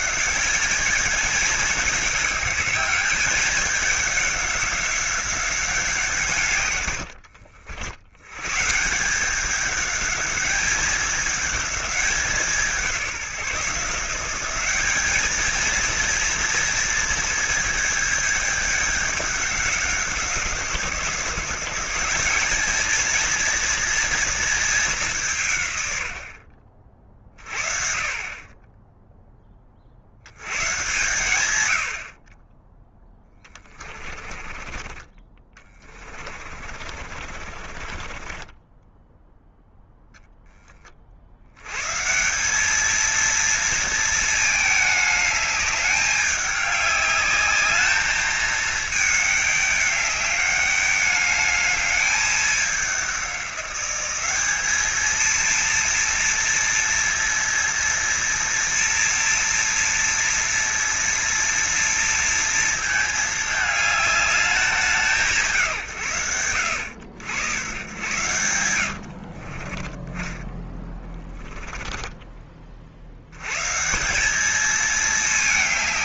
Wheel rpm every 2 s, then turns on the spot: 210, 200, 190, 120, 150, 200, 180, 200, 230, 210, 170, 220, 210, 40, 10, 100, 10, 30, 40, 10, 20, 210, 210, 200, 210, 210, 200, 210, 230, 230, 230, 220, 190, 90, 80, 20, 50, 210.
34-40 68-70